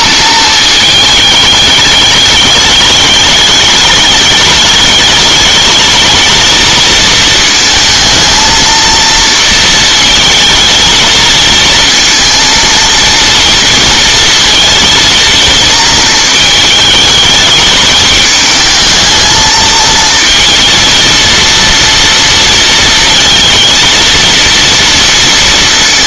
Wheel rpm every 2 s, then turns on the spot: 220, 210, 220, 220, 230, 220, 230, 230, 220, 220, 230, 230, 230.
none